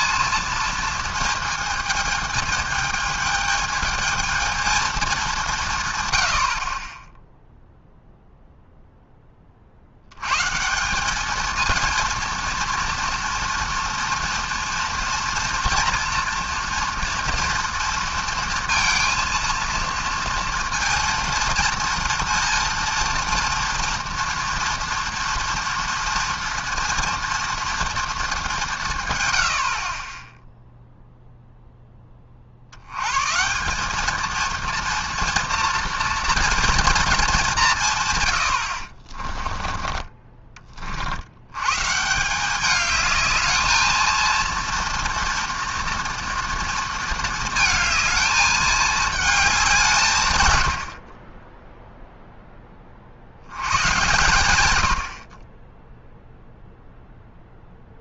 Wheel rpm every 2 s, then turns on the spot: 230, 220, 220, 60, 0, 140, 230, 230, 230, 230, 230, 230, 240, 230, 180, 0, 70, 230, 240, 90, 30, 200, 230, 230, 210, 100, 20, 110, 0.
none